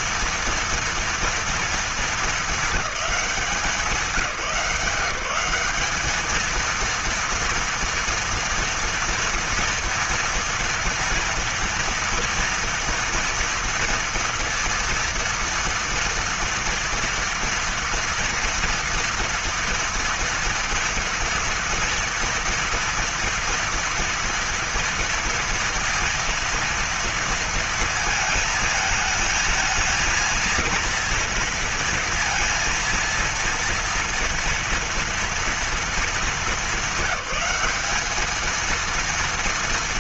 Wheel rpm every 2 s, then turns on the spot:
230, 220, 170, 220, 240, 230, 230, 230, 230, 230, 230, 230, 230, 230, 220, 230, 230, 230, 210, 220.
none